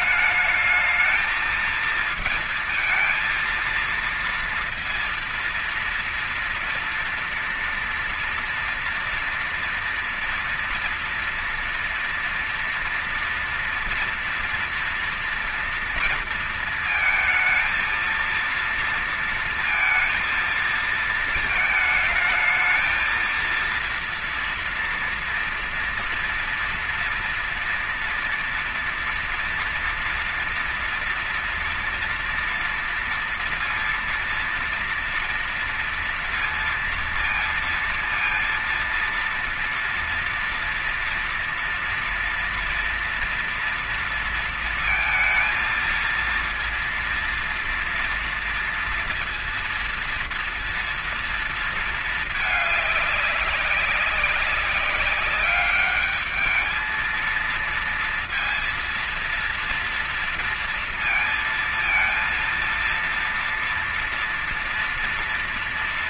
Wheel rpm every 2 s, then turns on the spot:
210, 230, 230, 230, 230, 230, 230, 230, 230, 230, 230, 220, 230, 230, 230, 230, 240, 230, 230, 230, 230, 230, 230, 230, 230, 230, 210, 190, 210, 230, 230, 230, 230.
none